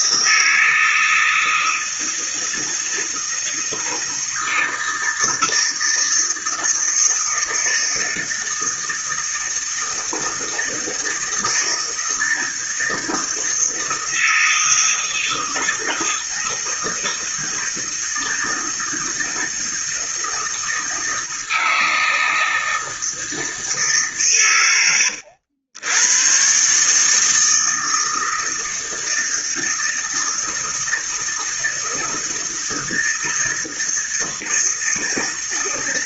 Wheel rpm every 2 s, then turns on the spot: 160, 160, 160, 160, 160, 160, 160, 160, 160, 160, 160, 160, 100, 140, 160, 160, 160, 160.
none